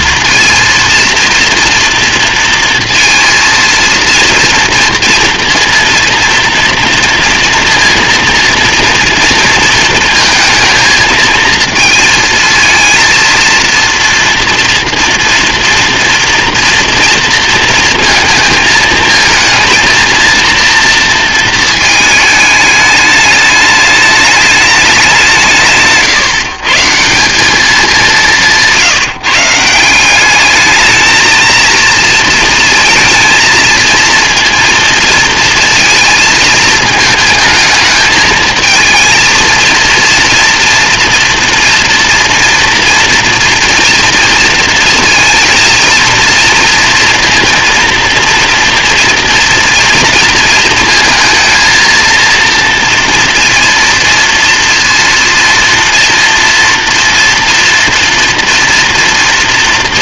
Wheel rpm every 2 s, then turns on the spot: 230, 230, 230, 230, 230, 220, 220, 230, 230, 220, 230, 220, 210, 150, 180, 200, 230, 230, 220, 220, 230, 230, 230, 230, 240, 230, 230, 230, 230, 230.
none